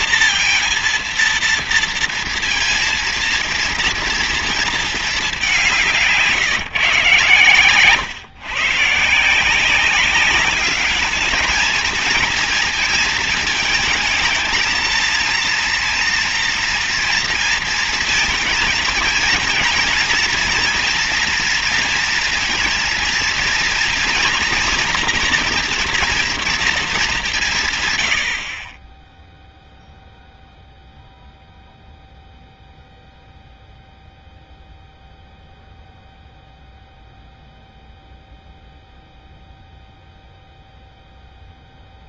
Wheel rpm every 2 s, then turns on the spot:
230, 230, 230, 150, 140, 200, 230, 220, 230, 220, 230, 230, 240, 230, 50, 0, 0, 0, 0, 0, 0.
none